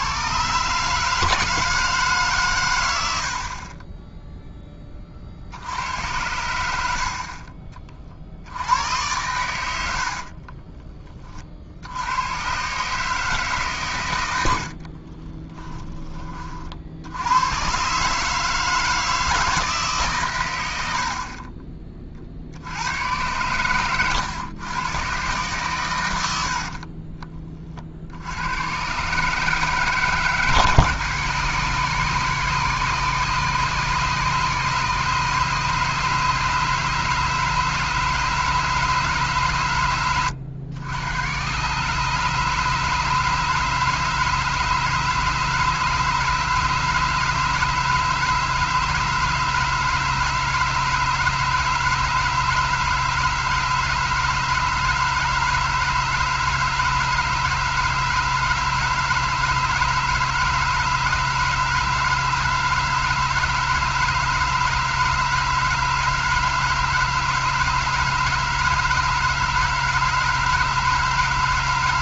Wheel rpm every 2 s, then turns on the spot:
150, 100, 20, 80, 90, 20, 140, 60, 60, 160, 80, 90, 120, 50, 120, 140, 140, 150, 150, 150, 90, 150, 150, 150, 150, 150, 150, 150, 160, 150, 150, 150, 150, 160, 160, 160.
14-16 26-28